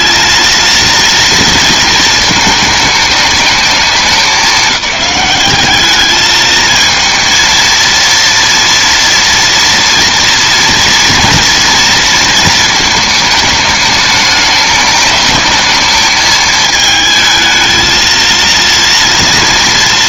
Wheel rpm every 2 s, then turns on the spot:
230, 210, 200, 220, 230, 230, 220, 210, 220, 230.
none